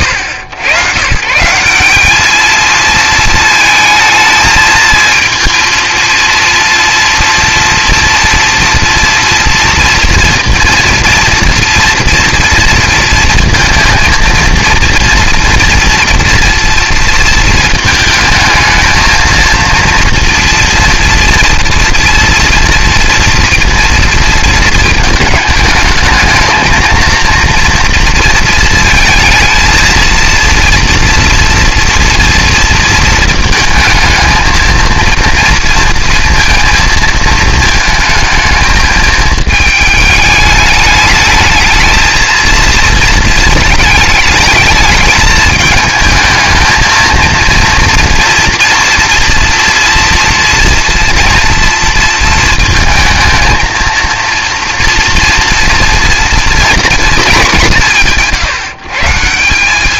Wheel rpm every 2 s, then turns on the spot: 90, 220, 220, 230, 230, 230, 230, 230, 230, 230, 240, 230, 220, 220, 230, 230, 230, 230, 230, 220, 210, 230, 220, 220, 230, 240, 230, 230, 230, 140.
none